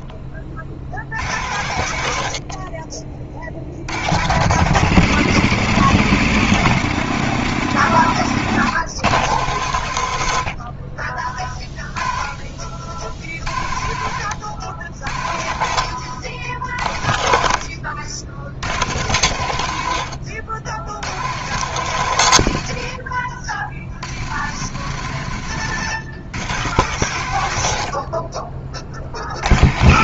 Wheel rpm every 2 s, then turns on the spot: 60, 40, 120, 140, 120, 60, 40, 80, 70, 90, 80, 100, 110, 120, 30.
none